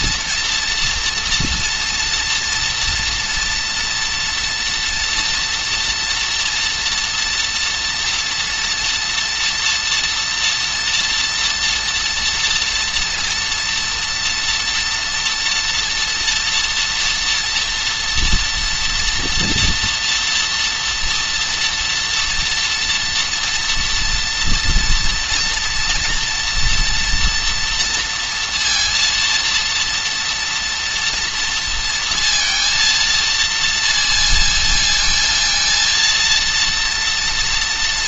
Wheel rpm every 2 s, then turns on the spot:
230, 230, 230, 230, 230, 230, 230, 230, 230, 230, 230, 230, 230, 240, 230, 230, 230, 230, 230.
none